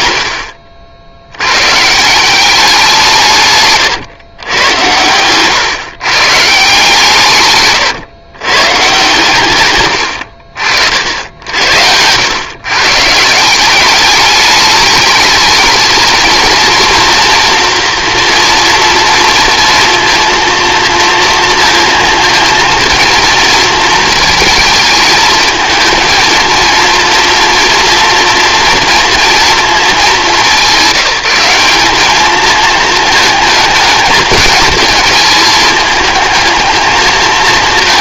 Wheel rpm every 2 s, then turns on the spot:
80, 190, 120, 150, 130, 60, 120, 210, 220, 230, 230, 230, 220, 230, 230, 200, 220, 220, 220.
10-12